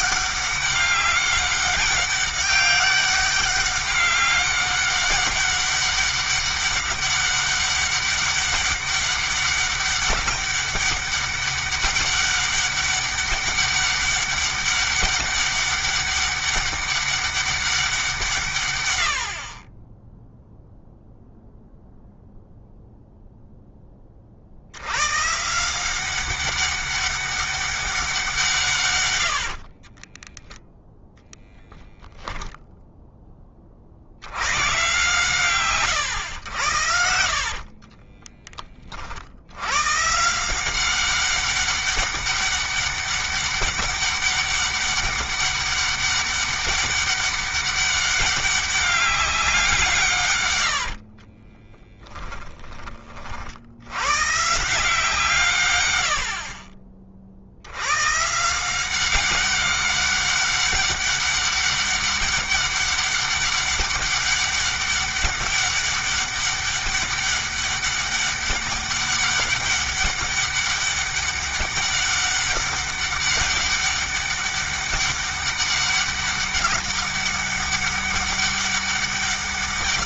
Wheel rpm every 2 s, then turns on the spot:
200, 200, 200, 200, 200, 200, 200, 200, 200, 120, 0, 0, 70, 190, 140, 10, 0, 120, 80, 30, 180, 200, 200, 200, 200, 70, 30, 160, 40, 180, 200, 200, 200, 200, 200, 200, 200, 200, 200, 200.
50-52